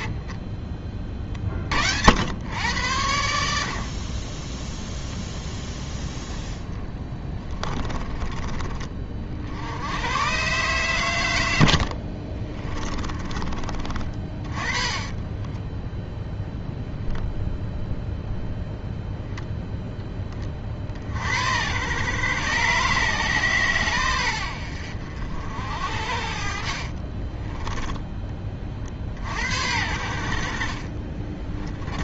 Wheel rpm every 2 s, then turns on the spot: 30, 100, 0, 20, 30, 120, 30, 30, 0, 0, 40, 130, 70, 40, 30, 40.
6-8 12-16 26-28